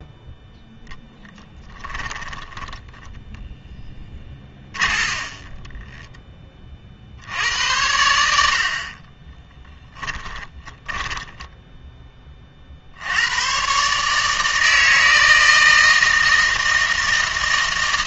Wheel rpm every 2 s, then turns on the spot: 0, 10, 40, 30, 60, 10, 60, 160, 160.
2-6 10-12